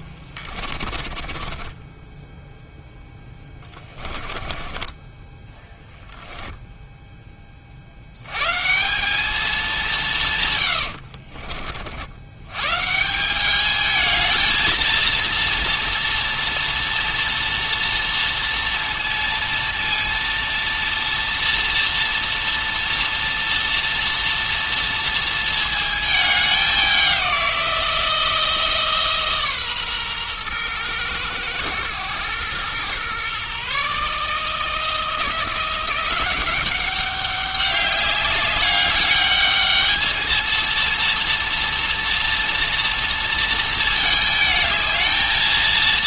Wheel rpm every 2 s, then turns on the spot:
40, 0, 20, 0, 150, 120, 130, 230, 240, 240, 230, 230, 230, 200, 160, 110, 110, 160, 190, 200, 230, 230, 220.
0-2 4-6 10-12